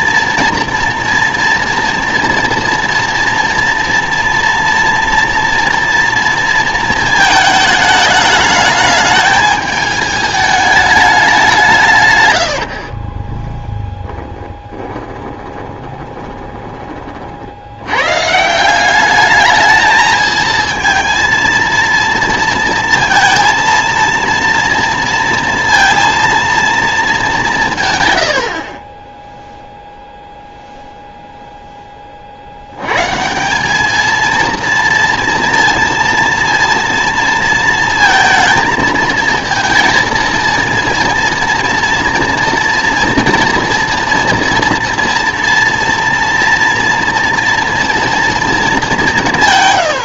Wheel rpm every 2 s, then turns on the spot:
240, 230, 230, 230, 210, 210, 50, 20, 20, 180, 230, 230, 230, 230, 50, 0, 100, 230, 230, 220, 230, 230, 230, 230, 210.
12-16